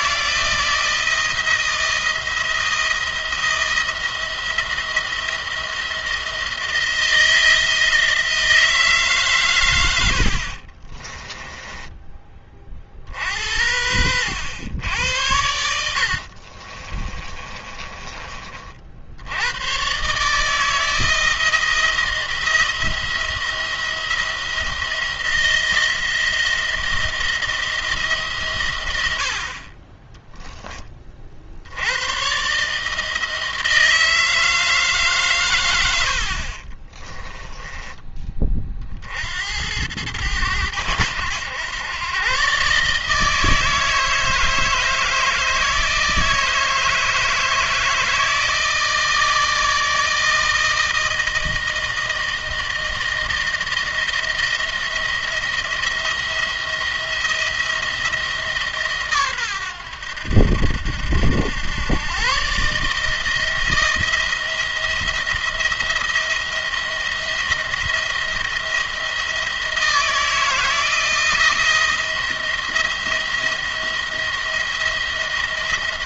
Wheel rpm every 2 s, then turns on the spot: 160, 170, 170, 170, 160, 50, 30, 90, 50, 40, 150, 170, 170, 170, 120, 10, 140, 160, 40, 40, 100, 140, 160, 160, 160, 160, 160, 170, 170, 150, 80, 140, 170, 170, 170, 160, 170, 170.
10-12 16-18 36-38